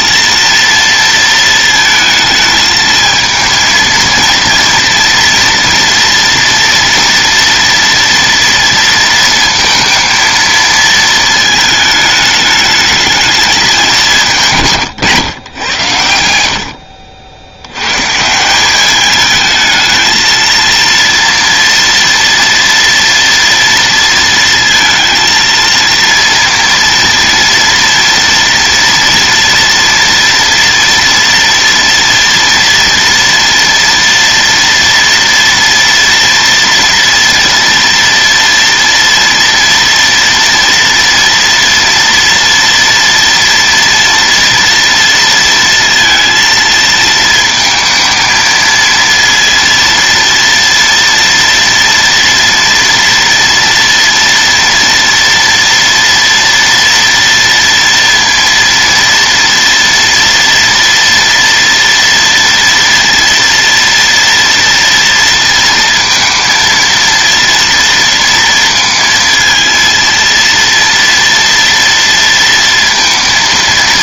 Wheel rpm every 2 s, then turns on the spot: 230, 220, 230, 230, 230, 220, 210, 140, 80, 190, 230, 230, 230, 230, 230, 230, 230, 230, 230, 230, 230, 230, 230, 220, 230, 230, 230, 230, 230, 230, 230, 230, 230, 230, 230, 230, 230.
none